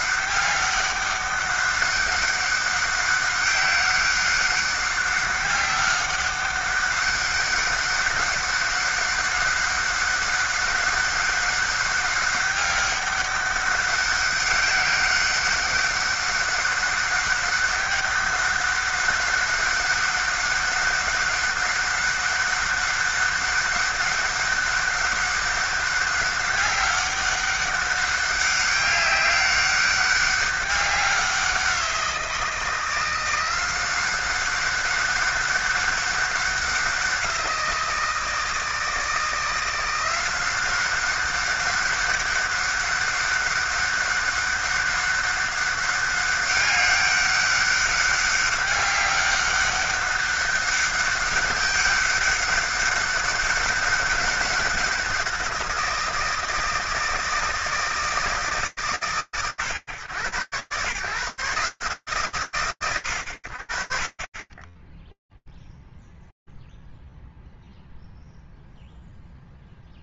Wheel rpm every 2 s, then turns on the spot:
200, 190, 200, 190, 200, 200, 200, 190, 200, 200, 200, 200, 200, 200, 200, 190, 170, 190, 190, 160, 190, 190, 190, 200, 200, 200, 200, 190, 160, 140, 130, 120, 20, 0, 0.
none